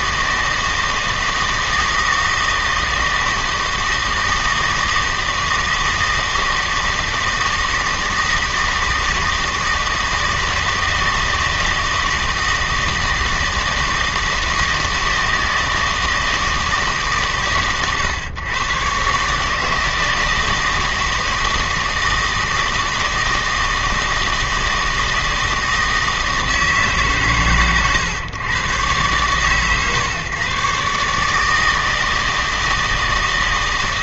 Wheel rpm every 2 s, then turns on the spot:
160, 160, 160, 160, 160, 160, 160, 160, 150, 120, 160, 160, 160, 150, 120, 140, 160.
none